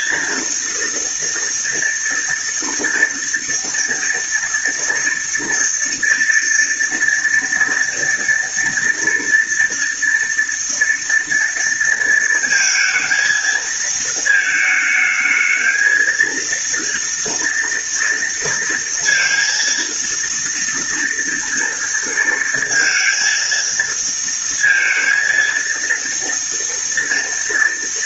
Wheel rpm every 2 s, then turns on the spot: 230, 230, 230, 230, 230, 230, 230, 220, 230, 230, 230, 230, 230, 230.
none